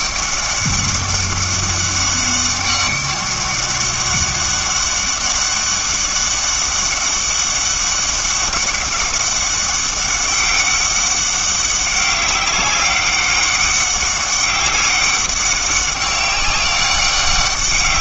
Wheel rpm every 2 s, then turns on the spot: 200, 200, 200, 200, 200, 200, 200, 200, 200.
none